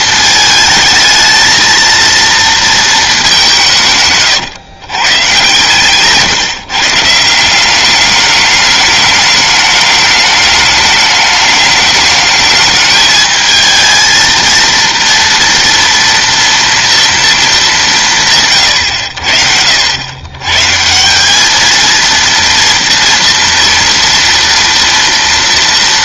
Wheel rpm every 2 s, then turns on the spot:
220, 230, 130, 150, 210, 210, 210, 230, 230, 130, 130, 230, 230.
none